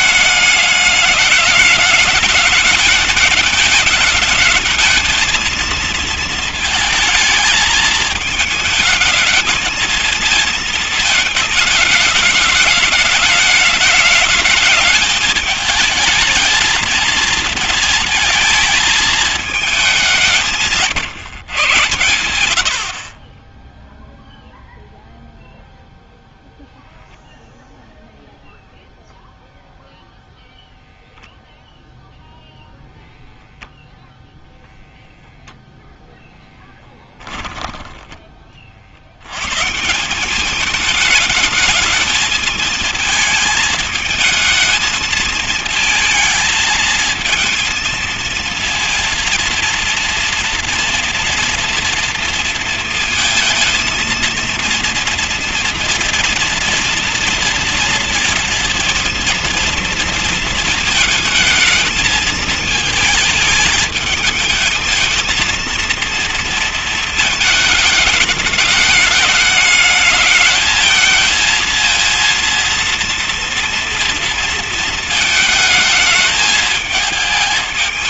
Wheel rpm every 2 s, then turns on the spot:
210, 210, 220, 220, 220, 220, 210, 220, 220, 220, 160, 50, 0, 0, 0, 0, 0, 0, 0, 40, 200, 220, 220, 220, 230, 230, 230, 230, 230, 230, 230, 220, 220, 230, 210, 220, 230, 220, 220.
none